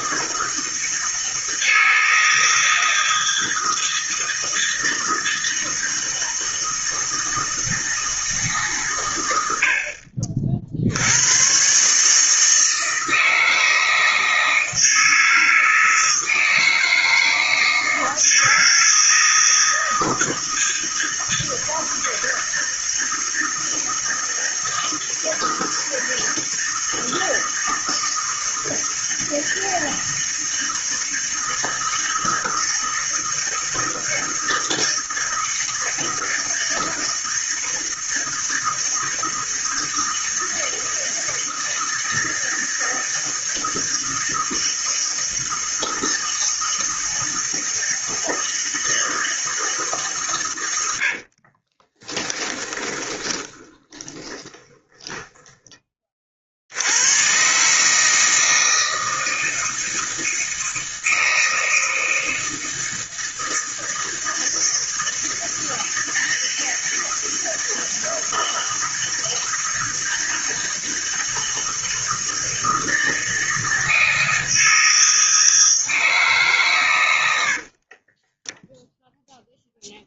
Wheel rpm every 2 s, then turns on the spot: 160, 160, 160, 160, 130, 60, 160, 160, 160, 160, 160, 160, 160, 160, 160, 160, 160, 160, 160, 160, 160, 160, 160, 160, 160, 100, 20, 10, 80, 160, 160, 160, 160, 160, 160, 160, 160, 160, 140, 10.
52-56 78-80